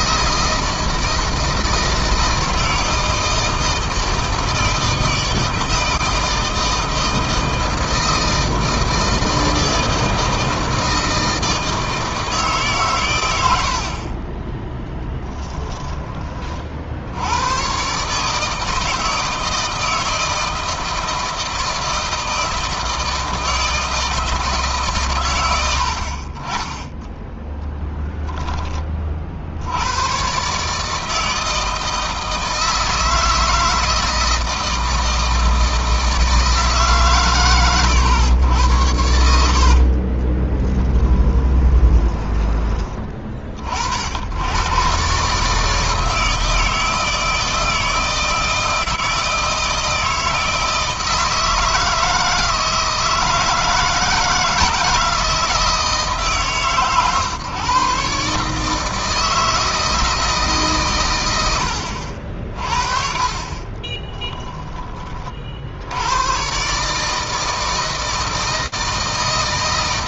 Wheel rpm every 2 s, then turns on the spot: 160, 160, 160, 160, 160, 160, 120, 10, 60, 160, 160, 160, 140, 20, 40, 150, 160, 160, 140, 70, 10, 20, 120, 160, 160, 160, 160, 160, 140, 160, 120, 40, 20, 140, 160.
38-42